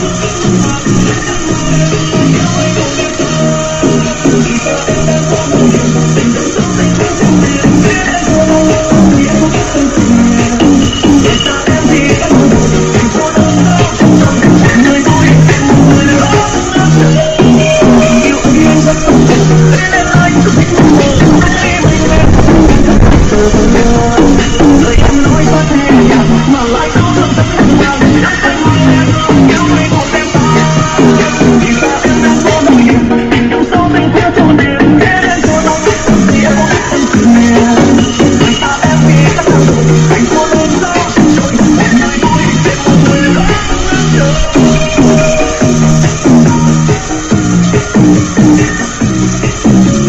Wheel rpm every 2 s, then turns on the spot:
160, 160, 160, 160, 160, 160, 160, 160, 150, 160, 160, 150, 160, 150, 150, 160, 70, 60, 160, 160, 160, 160, 160, 160, 160.
none